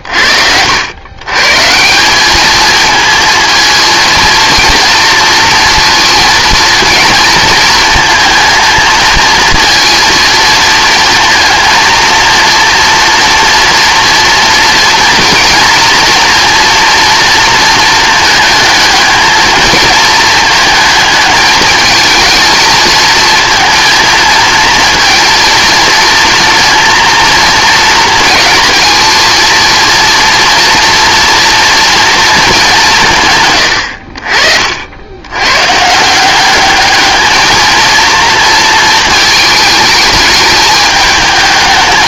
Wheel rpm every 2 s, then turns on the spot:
100, 220, 230, 230, 230, 220, 230, 230, 230, 220, 220, 220, 230, 230, 230, 230, 190, 70, 210, 230, 220.
none